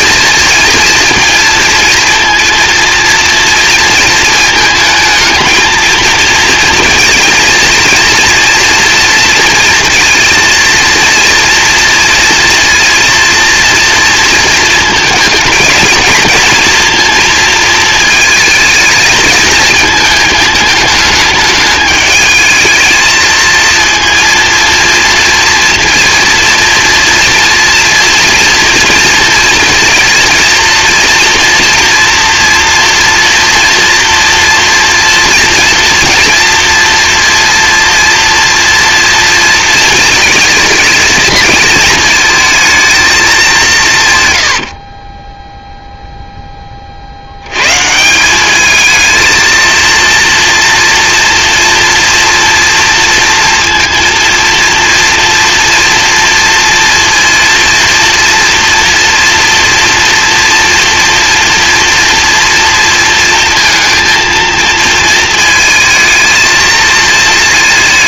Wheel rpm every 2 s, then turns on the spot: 220, 240, 220, 230, 230, 230, 230, 220, 230, 220, 220, 220, 230, 230, 230, 240, 230, 230, 230, 230, 220, 220, 20, 50, 220, 240, 240, 230, 240, 230, 230, 230, 230, 230.
44-46